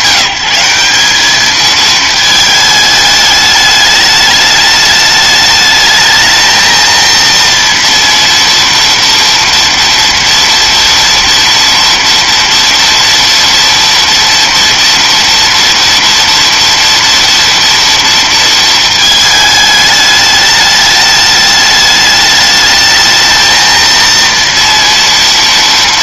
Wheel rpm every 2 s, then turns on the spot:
190, 220, 210, 220, 230, 230, 230, 230, 230, 230, 210, 210, 230.
none